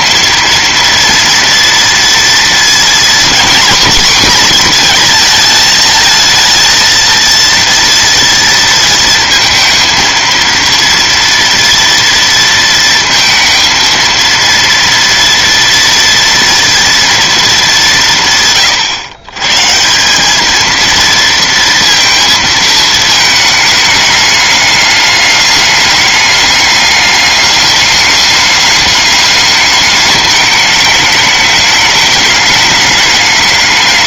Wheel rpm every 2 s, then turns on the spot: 230, 240, 230, 230, 230, 230, 230, 230, 230, 120, 230, 220, 210, 210, 210, 210, 210.
none